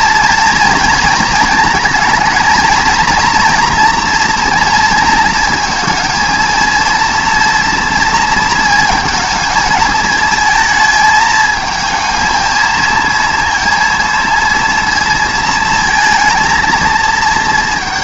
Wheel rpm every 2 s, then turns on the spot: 230, 230, 230, 230, 220, 220, 230, 230, 230.
none